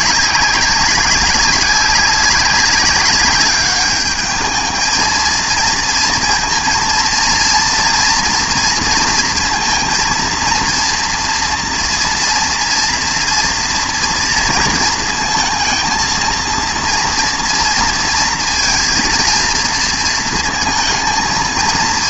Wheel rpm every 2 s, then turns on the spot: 190, 200, 220, 230, 230, 230, 230, 230, 230, 230, 230.
none